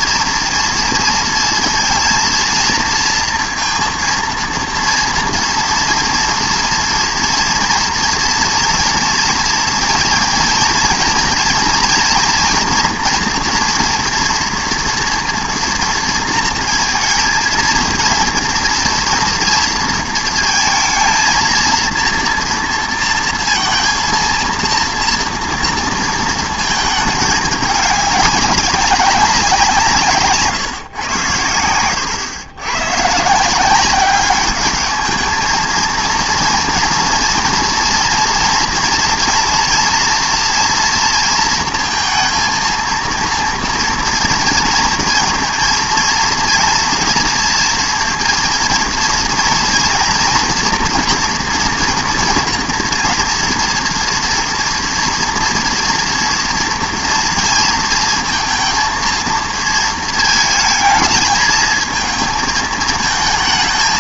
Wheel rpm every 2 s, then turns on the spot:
230, 230, 230, 230, 230, 230, 240, 230, 230, 230, 230, 230, 230, 220, 200, 140, 110, 200, 240, 240, 230, 230, 230, 230, 230, 240, 240, 230, 230, 230, 220, 220.
none